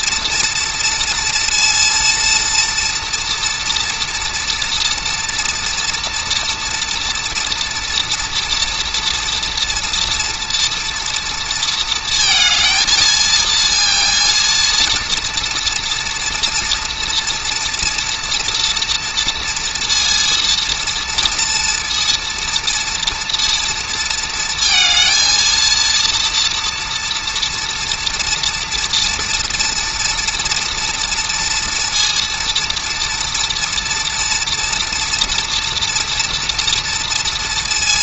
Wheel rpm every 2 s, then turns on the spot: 230, 230, 230, 230, 230, 230, 220, 230, 240, 230, 230, 230, 230, 240, 230, 230, 230, 240, 230.
none